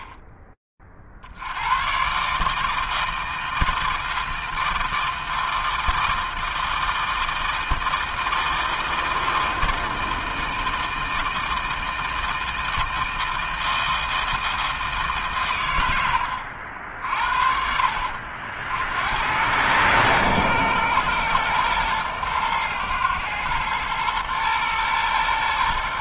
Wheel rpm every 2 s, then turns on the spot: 30, 150, 160, 160, 160, 160, 160, 160, 80, 70, 110, 110, 120.
none